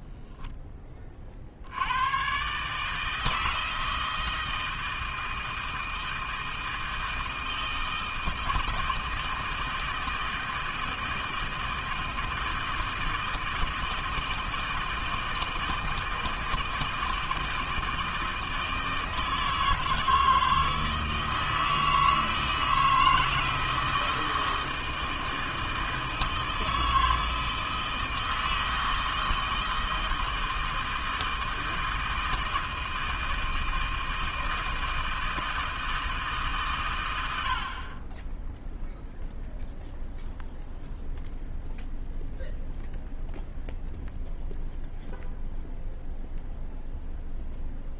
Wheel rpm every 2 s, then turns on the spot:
20, 150, 160, 160, 160, 160, 160, 160, 160, 160, 160, 160, 160, 160, 160, 160, 160, 160, 120, 0, 0, 0, 0, 0.
none